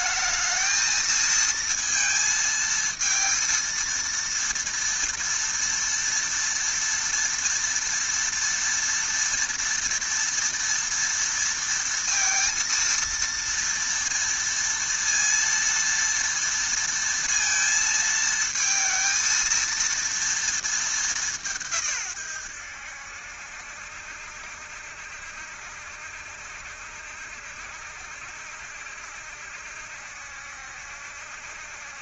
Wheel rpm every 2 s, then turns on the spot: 220, 220, 230, 230, 230, 230, 230, 230, 230, 230, 220, 90, 70, 70, 70, 70.
none